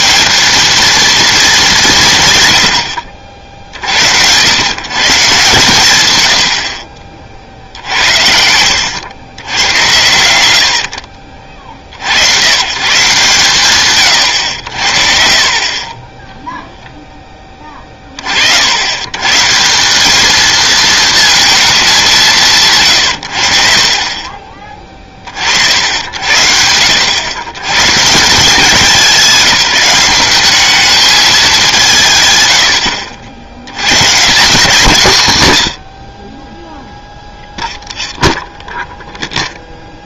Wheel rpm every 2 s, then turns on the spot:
230, 70, 140, 50, 90, 60, 140, 50, 10, 130, 230, 130, 30, 90, 190, 210, 60, 180, 0, 0.
none